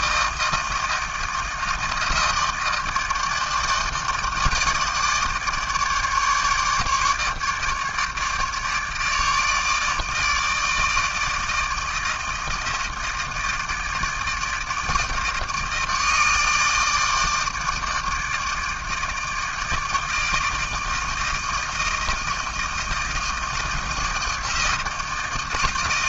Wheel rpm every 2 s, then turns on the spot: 160, 160, 160, 150, 150, 160, 160, 160, 160, 160, 160, 160, 160.
none